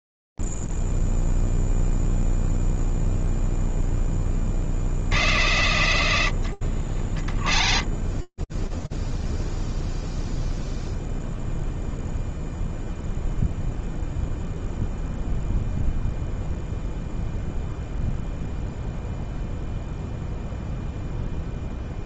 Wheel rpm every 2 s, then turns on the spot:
0, 0, 0, 100, 20, 0, 0, 0, 0, 0, 0.
none